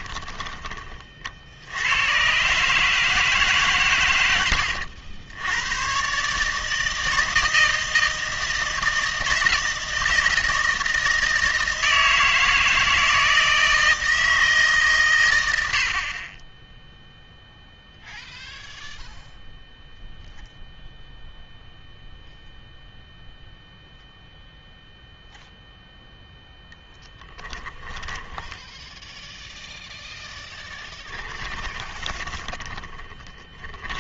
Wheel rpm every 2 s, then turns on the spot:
20, 150, 70, 150, 160, 160, 160, 150, 10, 0, 0, 0, 0, 0, 10, 10, 20.
28-34